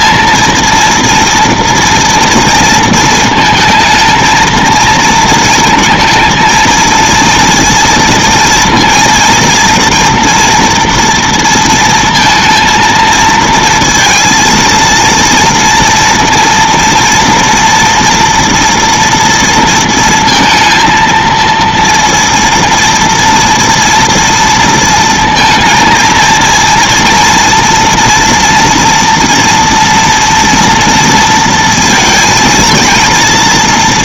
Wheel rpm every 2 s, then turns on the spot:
230, 230, 230, 220, 230, 230, 230, 230, 230, 230, 230, 230, 230, 230, 230, 230, 230.
none